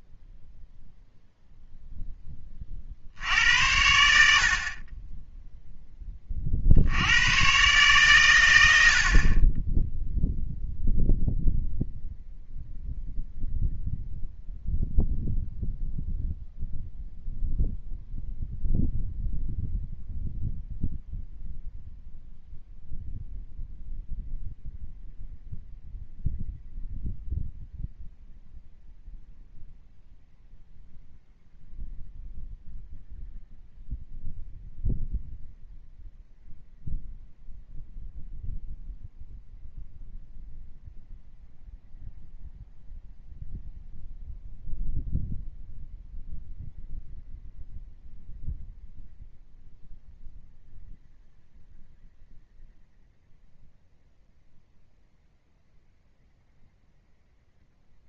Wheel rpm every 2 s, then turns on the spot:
0, 30, 50, 70, 90, 0, 0, 0, 0, 0, 0, 0, 0, 0, 0, 0, 0, 0, 0, 0, 0, 0, 0, 0, 0, 0, 0, 0, 0.
none